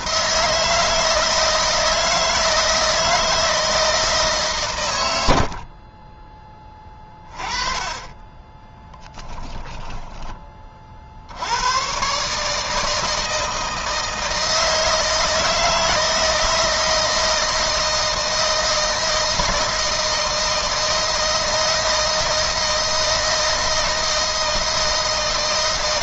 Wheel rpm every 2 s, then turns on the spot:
160, 160, 90, 30, 10, 60, 160, 160, 160, 160, 160, 160, 160.
8-10